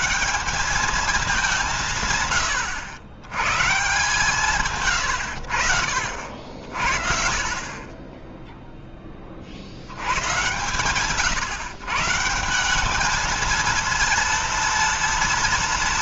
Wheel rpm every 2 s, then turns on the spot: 200, 100, 140, 60, 10, 110, 180, 230.
4-6